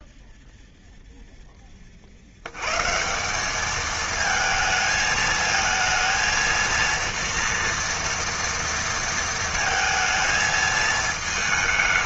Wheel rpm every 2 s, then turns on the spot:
0, 130, 220, 230, 230, 220.
none